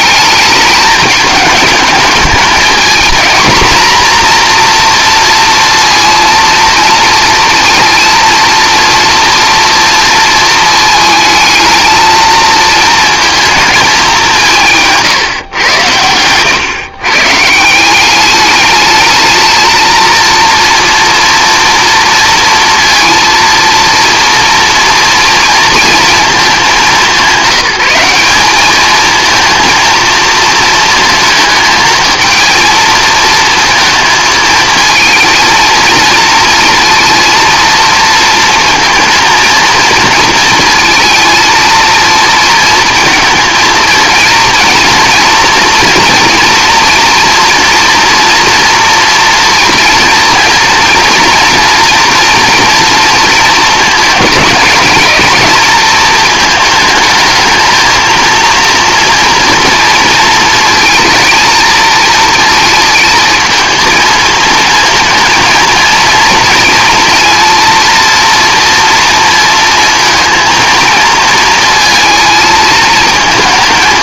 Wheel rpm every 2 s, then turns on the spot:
210, 220, 240, 230, 230, 220, 220, 160, 130, 210, 240, 230, 230, 210, 210, 220, 230, 220, 230, 230, 220, 230, 230, 230, 230, 230, 230, 220, 220, 230, 220, 230, 230, 230, 230, 230, 220.
none